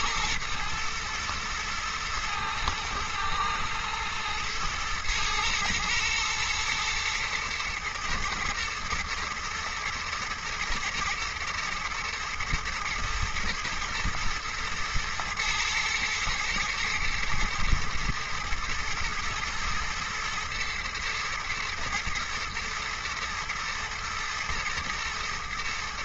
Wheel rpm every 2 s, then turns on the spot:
120, 110, 110, 120, 110, 120, 120, 110, 110, 110, 120, 110, 110.
none